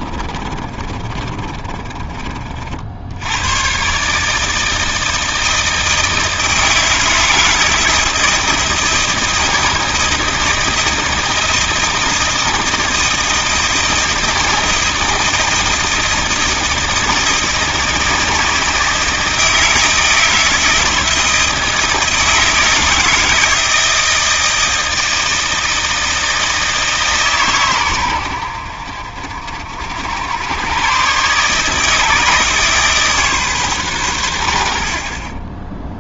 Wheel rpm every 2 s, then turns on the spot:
30, 50, 160, 160, 160, 160, 160, 160, 160, 160, 160, 160, 160, 160, 70, 100, 150, 80.
0-2